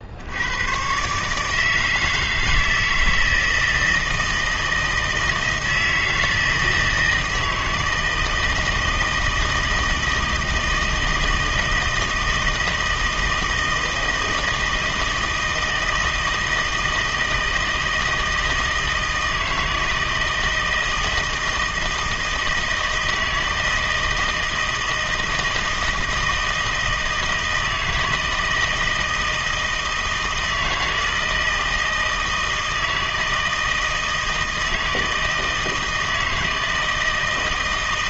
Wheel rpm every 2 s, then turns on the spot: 110, 160, 160, 160, 160, 160, 160, 160, 160, 160, 160, 160, 160, 160, 160, 160, 160, 160, 160.
none